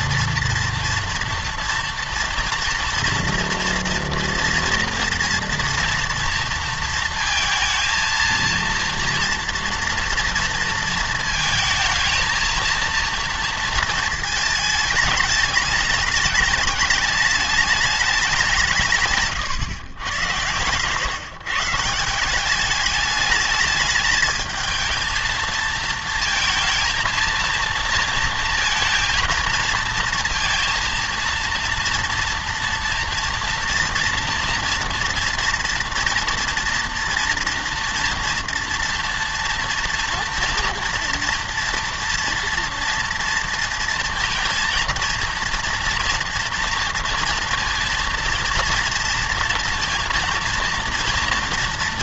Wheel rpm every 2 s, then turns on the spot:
230, 230, 230, 230, 230, 230, 230, 220, 210, 180, 120, 200, 220, 230, 220, 230, 240, 230, 230, 230, 230, 230, 230, 230, 230, 230.
20-22